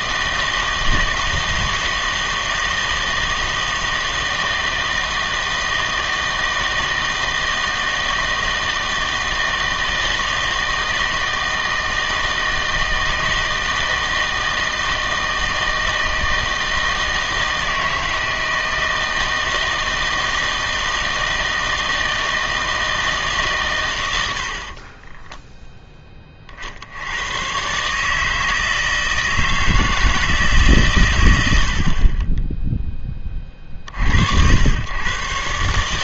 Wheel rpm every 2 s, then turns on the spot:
160, 160, 160, 160, 160, 160, 160, 160, 160, 160, 160, 160, 50, 50, 160, 150, 10, 100.
none